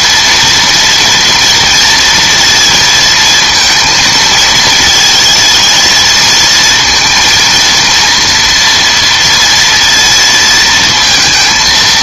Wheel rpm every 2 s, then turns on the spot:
230, 230, 220, 230, 230, 230.
none